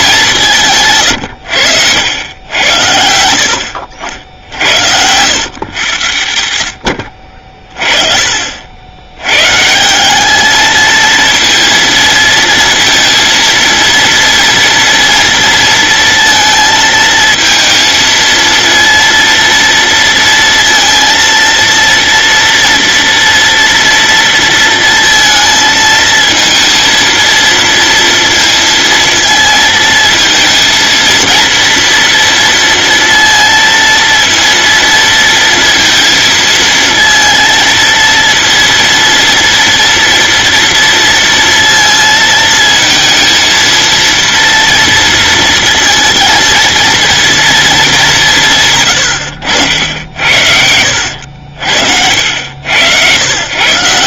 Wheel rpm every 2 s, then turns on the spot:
160, 90, 70, 80, 70, 220, 230, 230, 230, 230, 230, 230, 230, 230, 230, 230, 230, 230, 230, 230, 230, 220, 230, 230, 120, 80, 90.
48-50